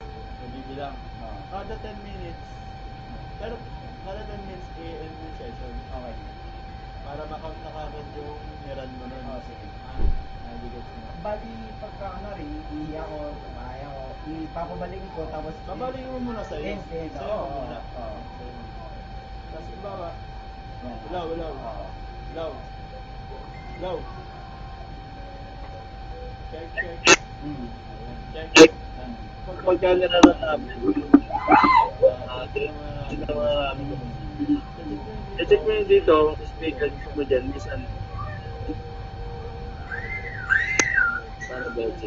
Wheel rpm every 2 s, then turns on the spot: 0, 0, 0, 0, 0, 0, 0, 0, 0, 0, 0, 0, 0, 0, 0, 0, 0, 0, 0, 0, 0.
none